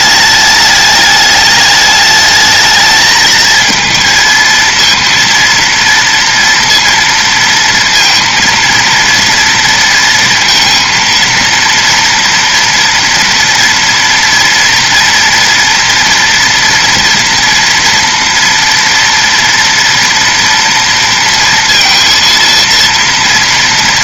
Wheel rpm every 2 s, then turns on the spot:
210, 220, 230, 230, 230, 230, 230, 230, 230, 230, 230, 230.
none